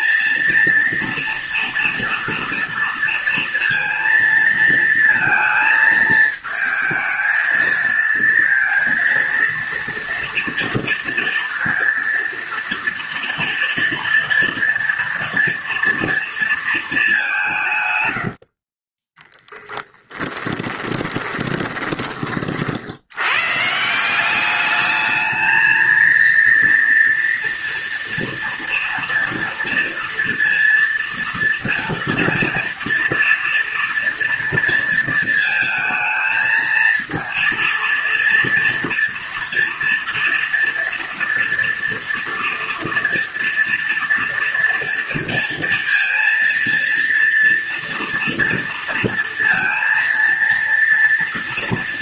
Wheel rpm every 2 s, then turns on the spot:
230, 230, 230, 220, 230, 230, 230, 240, 230, 60, 10, 50, 200, 230, 230, 230, 230, 230, 230, 230, 230, 230, 230, 230, 230, 230.
18-22